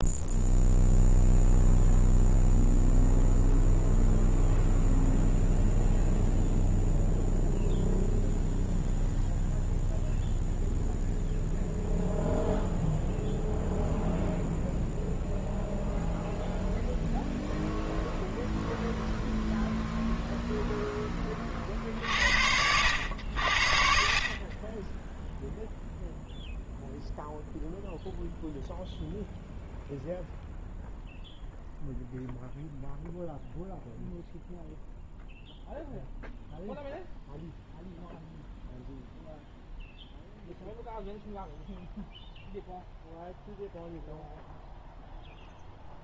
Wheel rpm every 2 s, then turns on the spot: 0, 0, 0, 0, 0, 0, 0, 0, 0, 0, 0, 80, 30, 0, 0, 0, 0, 0, 0, 0, 0, 0, 0.
none